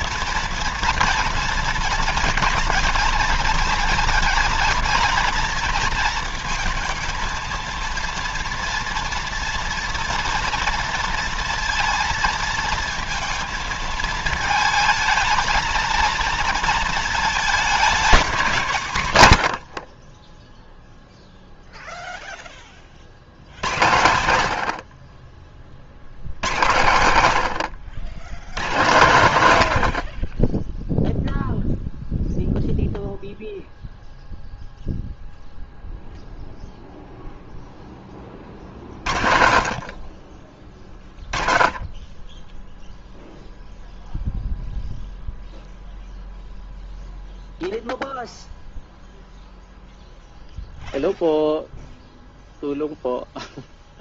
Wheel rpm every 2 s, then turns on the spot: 230, 230, 230, 220, 230, 230, 230, 220, 220, 180, 10, 20, 80, 100, 110, 20, 0, 0, 0, 40, 20, 0, 0, 0, 0, 0, 0.
none